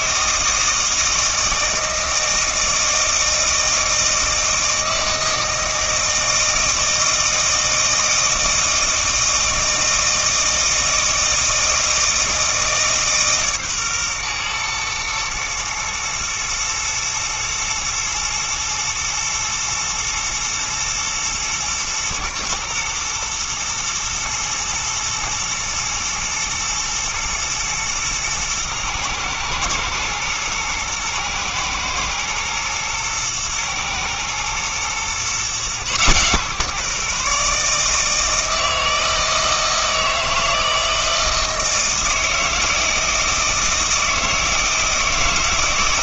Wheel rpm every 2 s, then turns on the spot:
160, 160, 160, 160, 160, 160, 160, 120, 110, 110, 120, 120, 120, 110, 110, 120, 120, 120, 140, 160, 160, 160, 160.
none